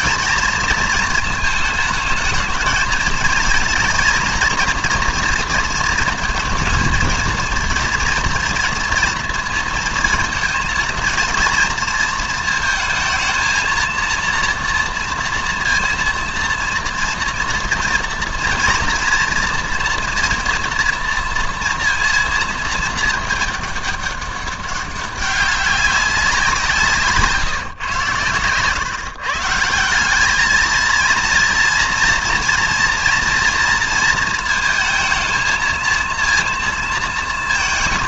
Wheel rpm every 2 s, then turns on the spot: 230, 220, 230, 230, 230, 230, 220, 230, 230, 230, 230, 220, 190, 170, 120, 220, 230, 220, 230.
none